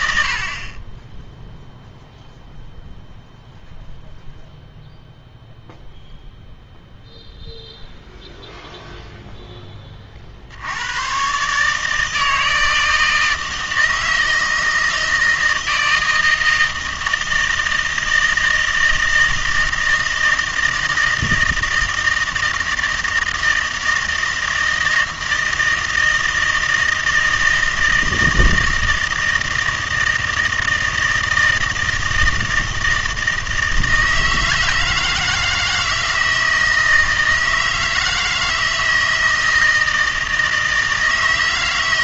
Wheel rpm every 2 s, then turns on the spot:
40, 0, 0, 0, 0, 80, 160, 160, 160, 160, 160, 160, 160, 160, 160, 160, 160, 160, 160, 160, 160.
none